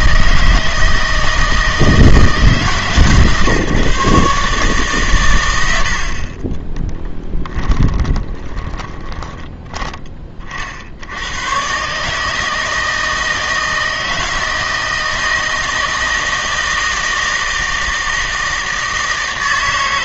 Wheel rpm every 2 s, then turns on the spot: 160, 150, 140, 20, 20, 60, 160, 160, 160, 160.
6-10